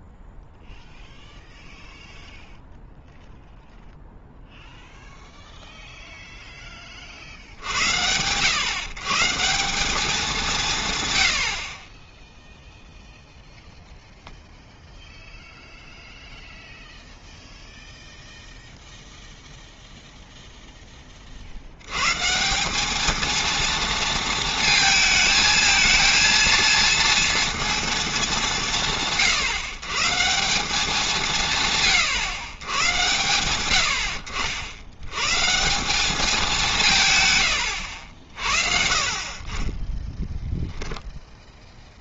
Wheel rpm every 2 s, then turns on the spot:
0, 0, 0, 10, 110, 180, 0, 0, 0, 0, 10, 200, 220, 230, 160, 190, 120, 70, 180, 50, 10.
none